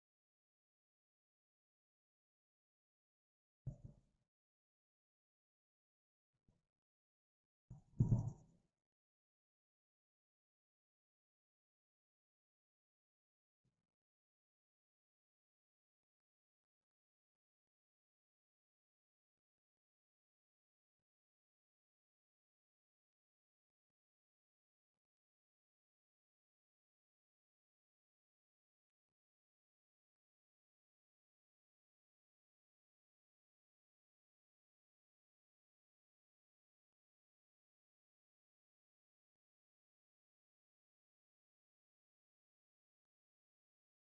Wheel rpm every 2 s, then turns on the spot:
0, 0, 0, 0, 0, 0, 0, 0, 0, 0, 0, 0, 0, 0, 0, 0, 0, 0, 0, 0, 0, 0.
none